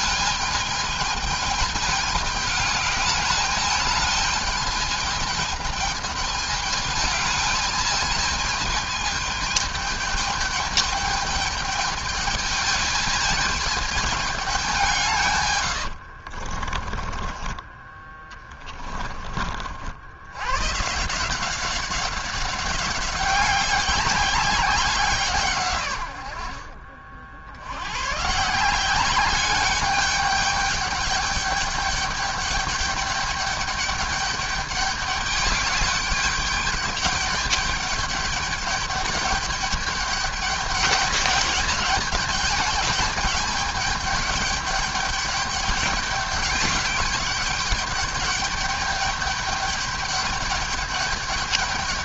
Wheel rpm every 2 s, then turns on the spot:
220, 210, 220, 210, 220, 210, 220, 180, 40, 20, 140, 200, 180, 50, 190, 210, 200, 200, 210, 210, 200, 200, 200, 200, 210, 210.
16-18